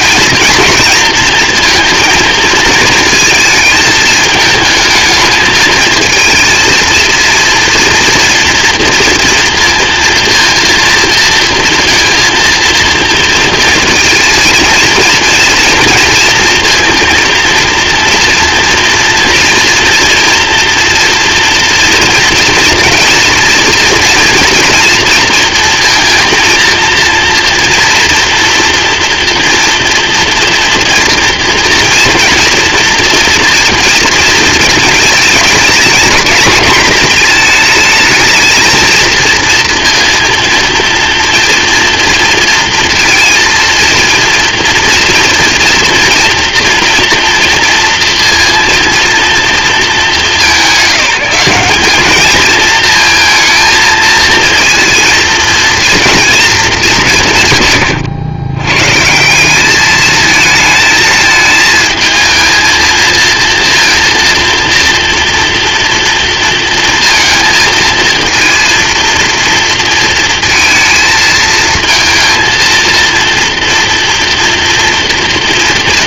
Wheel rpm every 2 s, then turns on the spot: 230, 220, 220, 230, 230, 230, 230, 230, 220, 230, 230, 230, 240, 230, 240, 230, 230, 220, 220, 230, 230, 230, 230, 230, 230, 190, 230, 230, 200, 120, 220, 220, 240, 230, 230, 230, 230, 240.
none